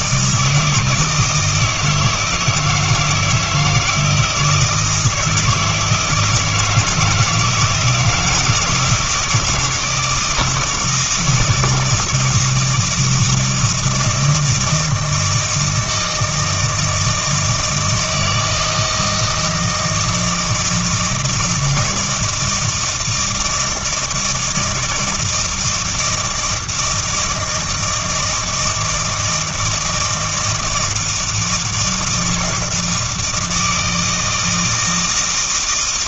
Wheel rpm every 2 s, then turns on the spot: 160, 160, 160, 170, 160, 160, 160, 160, 160, 160, 160, 160, 160, 160, 160, 160, 160, 160.
none